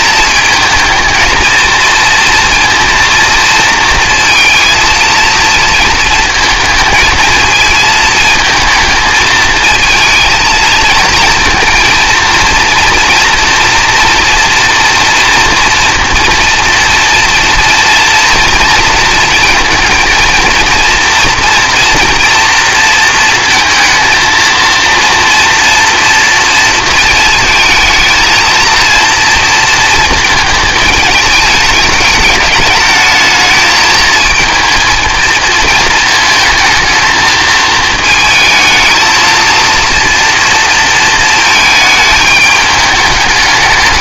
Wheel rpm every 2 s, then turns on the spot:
220, 230, 230, 220, 220, 220, 230, 240, 230, 230, 230, 230, 230, 230, 230, 220, 210, 230, 220, 220, 230, 210.
none